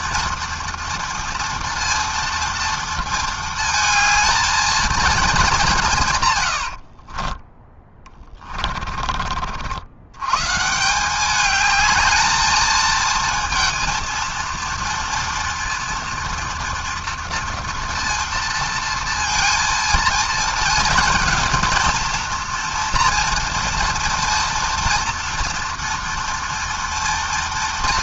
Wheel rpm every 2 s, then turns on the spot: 230, 230, 220, 30, 40, 200, 230, 230, 240, 230, 230, 230, 230, 230.
6-8